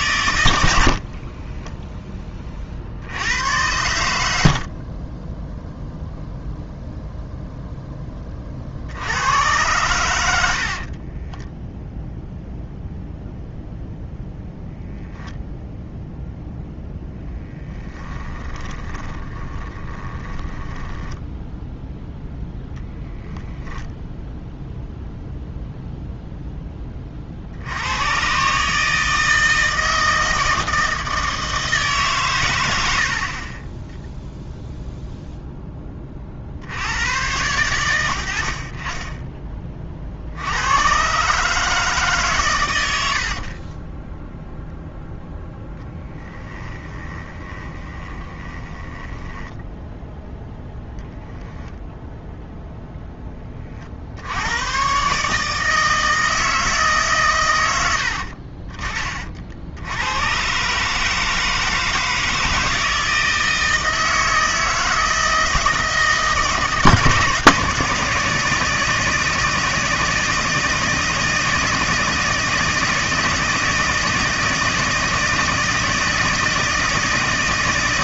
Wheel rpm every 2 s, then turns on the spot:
60, 60, 40, 0, 70, 50, 0, 0, 0, 10, 10, 0, 0, 10, 150, 160, 80, 0, 90, 40, 110, 80, 0, 20, 10, 0, 10, 130, 150, 30, 150, 160, 160, 150, 160, 160, 160, 160, 170.
4-6 10-12 18-20 32-34 46-50